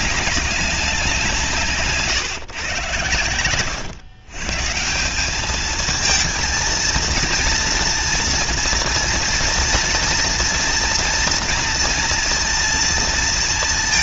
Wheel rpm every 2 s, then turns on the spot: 190, 120, 150, 230, 230, 240, 230.
none